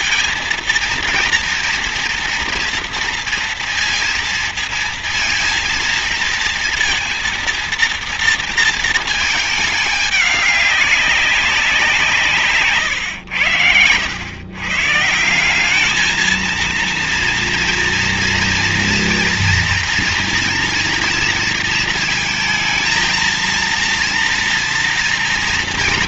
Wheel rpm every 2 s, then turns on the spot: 230, 230, 230, 230, 230, 200, 140, 120, 220, 230, 230, 220, 230.
none